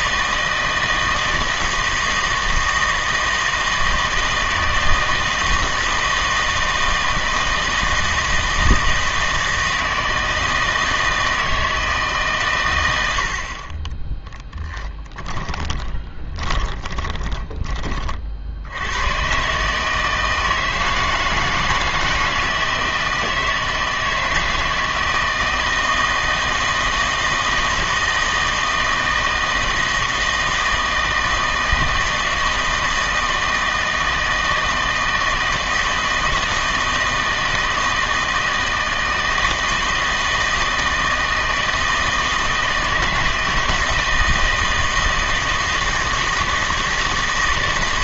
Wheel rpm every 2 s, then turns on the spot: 160, 160, 160, 160, 160, 160, 130, 10, 30, 80, 160, 160, 160, 160, 160, 160, 160, 160, 160, 160, 160, 160, 160, 160.
14-18